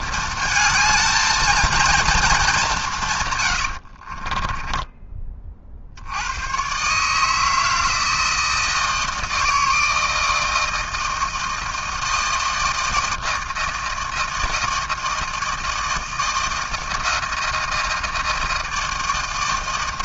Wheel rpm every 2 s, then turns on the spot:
220, 140, 30, 160, 160, 160, 160, 160, 160, 160.
2-4